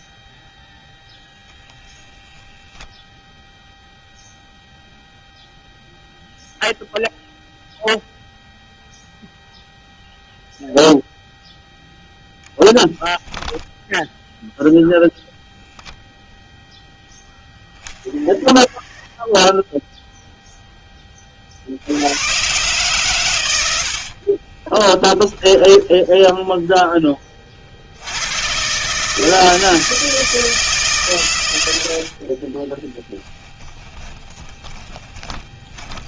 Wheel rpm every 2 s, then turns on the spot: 0, 10, 0, 0, 0, 0, 0, 0, 0, 0, 0, 120, 30, 10, 110, 160, 40, 20.
24-26 32-36